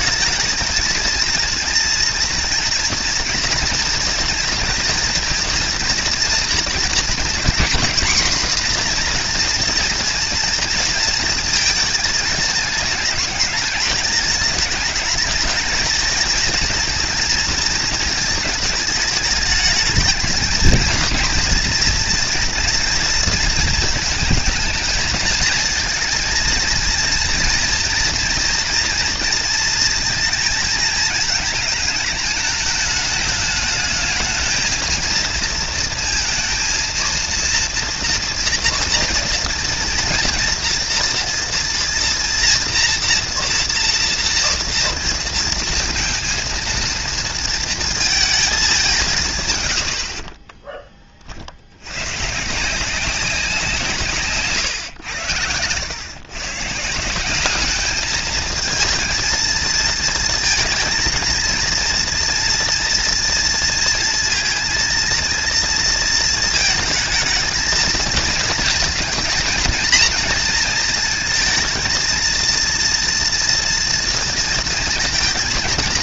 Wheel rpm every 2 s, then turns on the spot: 220, 240, 240, 230, 240, 230, 210, 220, 230, 220, 220, 230, 220, 230, 230, 220, 210, 220, 230, 230, 230, 230, 230, 230, 190, 20, 180, 130, 150, 220, 230, 230, 230, 220, 230, 230, 230, 230.
none